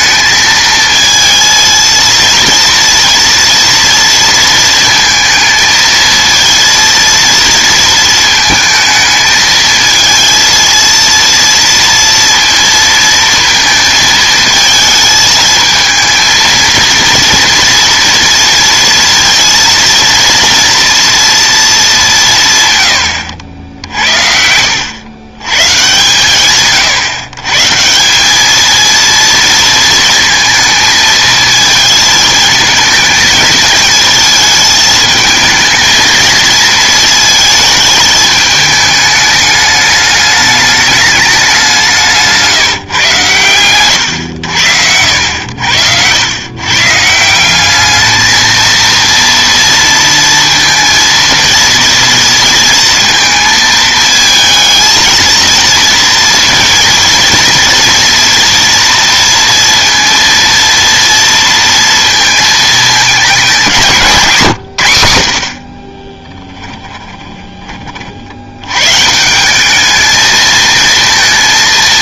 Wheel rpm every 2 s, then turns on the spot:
220, 230, 230, 230, 220, 230, 230, 220, 230, 230, 240, 140, 80, 140, 220, 220, 220, 220, 230, 210, 210, 160, 90, 130, 230, 230, 230, 220, 230, 240, 230, 220, 130, 10, 110, 220.
64-68